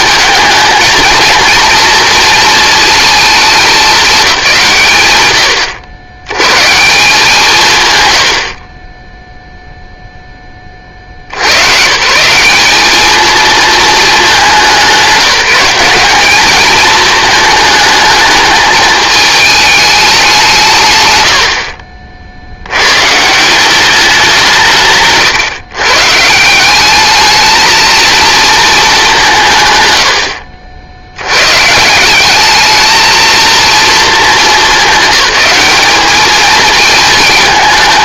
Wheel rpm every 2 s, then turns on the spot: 220, 230, 180, 160, 40, 30, 190, 190, 210, 220, 190, 90, 160, 180, 220, 70, 210, 210, 220.
none